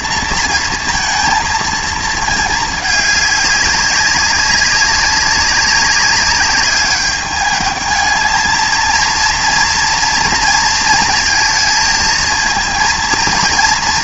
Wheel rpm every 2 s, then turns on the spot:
230, 210, 190, 200, 220, 230, 230.
none